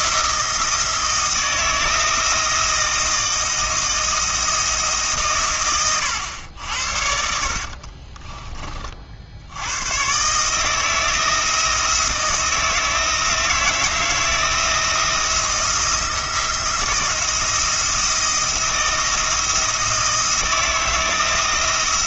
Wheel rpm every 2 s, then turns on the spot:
160, 160, 160, 70, 30, 160, 160, 160, 170, 170, 160.
none